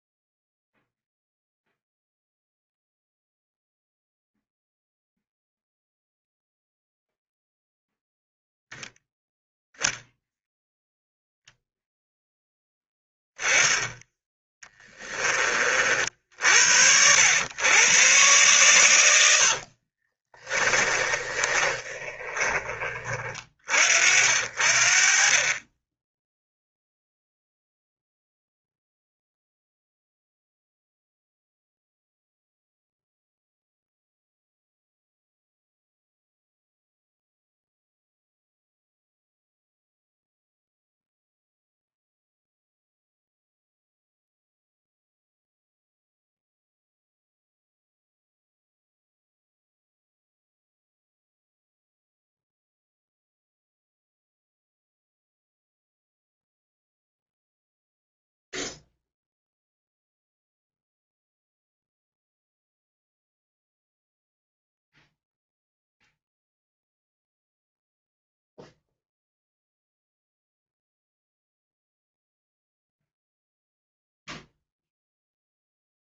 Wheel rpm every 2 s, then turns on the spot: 0, 0, 0, 0, 0, 0, 10, 10, 80, 110, 20, 30, 50, 0, 0, 0, 0, 0, 0, 0, 0, 0, 0, 0, 0, 0, 0, 0, 0, 0, 0, 0, 0, 0, 0, 0, 0, 0.
14-16 20-22